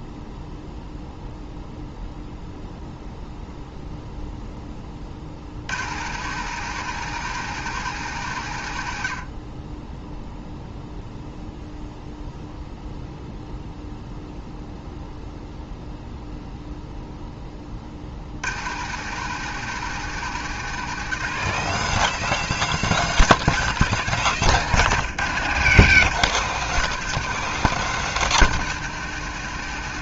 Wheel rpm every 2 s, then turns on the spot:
0, 0, 20, 170, 100, 0, 0, 0, 0, 120, 170, 200, 160, 190, 180.
none